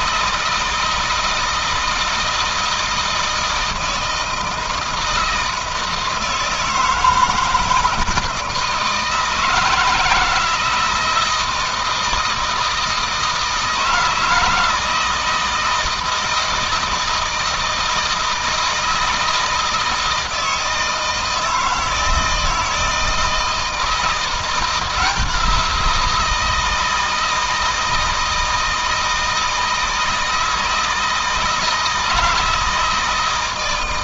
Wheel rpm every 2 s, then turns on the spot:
160, 160, 160, 160, 160, 160, 160, 160, 160, 160, 160, 160, 170, 160, 160, 160, 160.
none